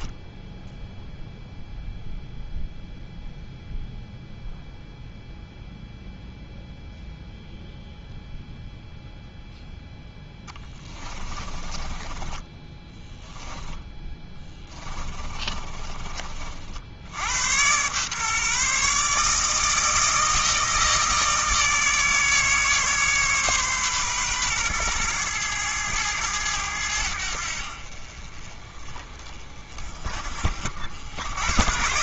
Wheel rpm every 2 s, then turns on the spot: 0, 0, 0, 0, 0, 20, 10, 20, 70, 150, 160, 140, 120, 90, 30, 70.
10-16